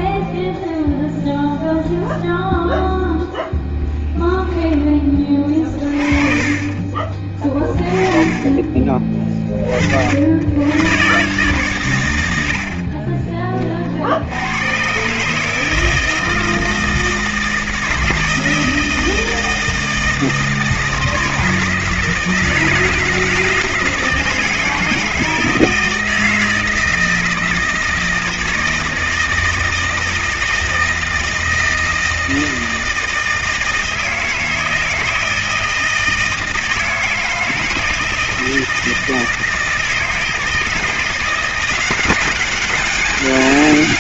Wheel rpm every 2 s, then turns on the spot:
0, 0, 20, 30, 30, 100, 60, 100, 160, 160, 160, 170, 160, 160, 160, 160, 160, 160, 160, 160, 160, 200.
6-8 12-14